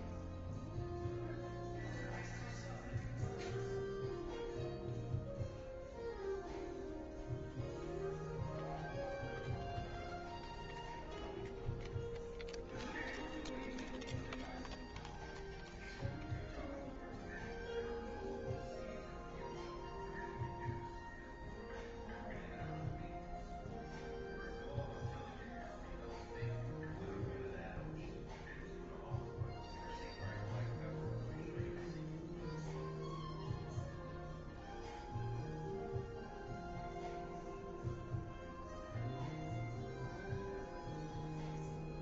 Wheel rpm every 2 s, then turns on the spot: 0, 0, 0, 0, 0, 0, 0, 0, 0, 0, 0, 0, 0, 0, 0, 0, 0, 0, 0, 0, 0.
none